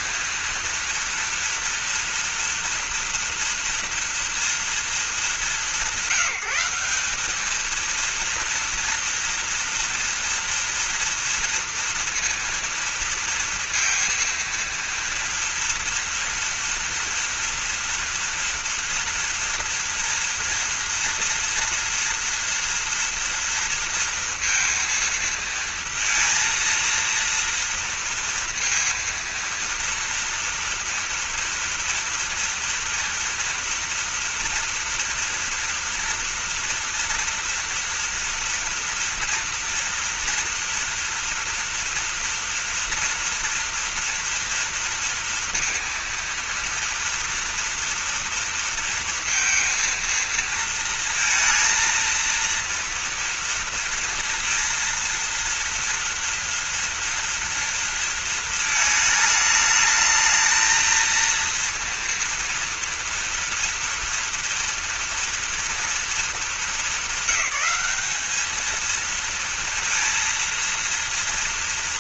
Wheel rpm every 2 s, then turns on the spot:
230, 230, 220, 180, 230, 230, 230, 230, 240, 230, 230, 230, 230, 230, 230, 230, 230, 230, 230, 230, 240, 230, 230, 230, 230, 230, 230, 230, 230, 220, 220, 230, 230, 210, 220, 230.
none